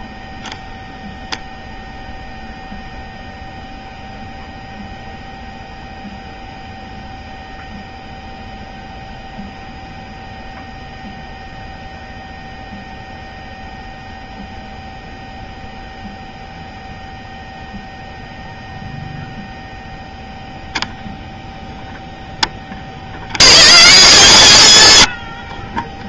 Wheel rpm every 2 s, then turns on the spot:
0, 0, 0, 0, 0, 0, 0, 0, 0, 0, 0, 10, 70.
none